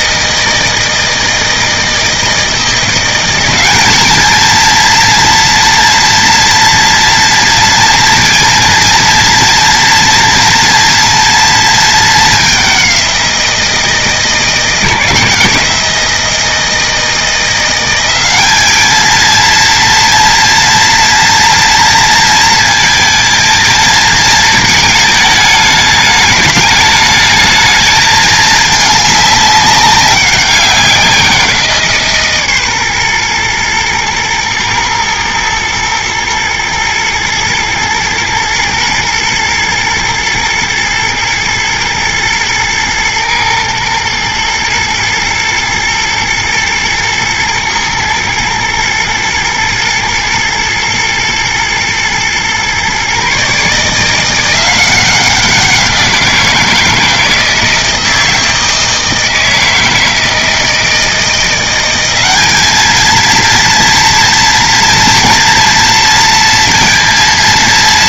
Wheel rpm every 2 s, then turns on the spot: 160, 170, 230, 240, 230, 230, 190, 170, 160, 220, 240, 230, 220, 210, 210, 190, 130, 110, 120, 120, 110, 120, 110, 110, 110, 110, 130, 180, 170, 160, 160, 220, 230, 230.
none